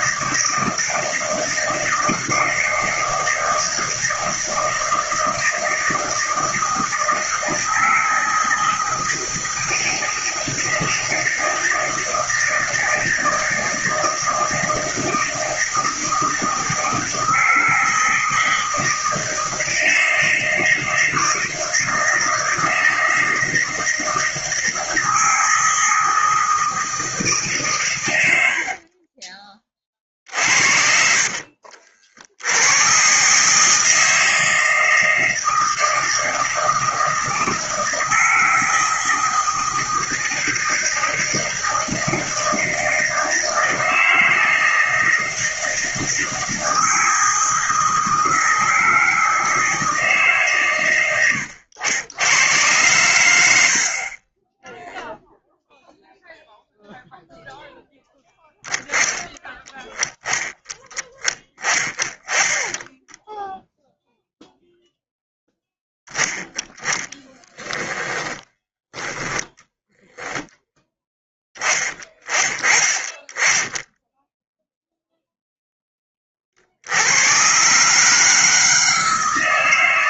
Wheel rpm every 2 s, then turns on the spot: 160, 160, 160, 160, 160, 160, 160, 160, 160, 160, 160, 160, 160, 160, 80, 50, 80, 160, 160, 160, 160, 160, 160, 160, 160, 140, 100, 20, 0, 10, 10, 20, 0, 20, 10, 0, 20, 0, 50, 160.
54-56